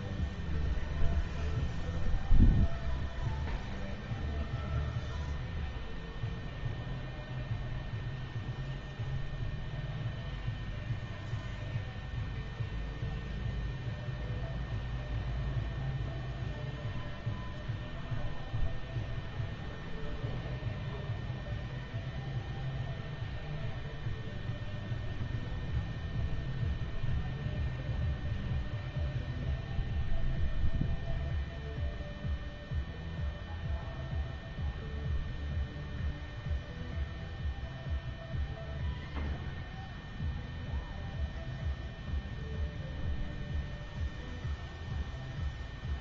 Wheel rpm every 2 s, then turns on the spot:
0, 0, 0, 0, 0, 0, 0, 0, 0, 0, 0, 0, 0, 0, 0, 0, 0, 0, 0, 0, 0, 0, 0.
none